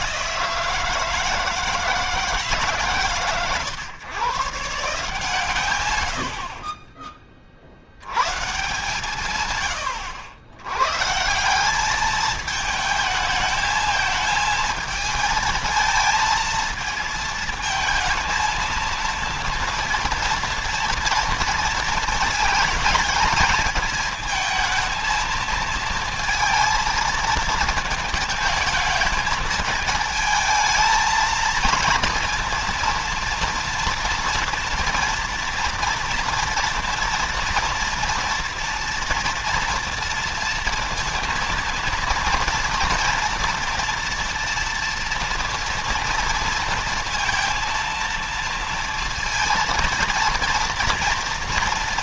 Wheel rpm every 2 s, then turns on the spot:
160, 150, 140, 40, 130, 110, 220, 220, 220, 220, 230, 220, 220, 220, 220, 220, 230, 230, 230, 230, 230, 230, 230, 230, 230, 230.
none